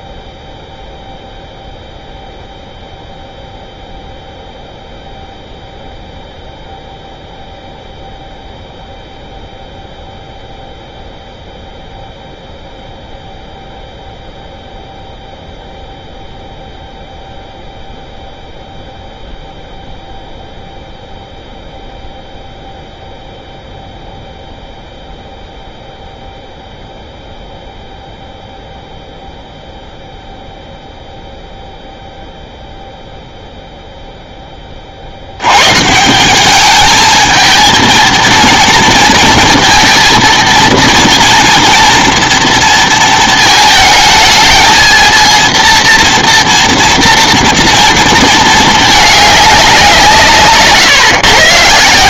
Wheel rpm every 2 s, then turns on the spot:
0, 0, 0, 0, 0, 0, 0, 0, 0, 0, 0, 0, 0, 0, 0, 0, 0, 20, 200, 230, 230, 230, 220, 230, 220, 140.
none